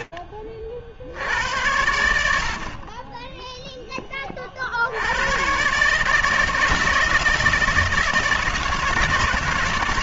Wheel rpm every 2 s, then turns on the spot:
50, 50, 80, 160, 170.
none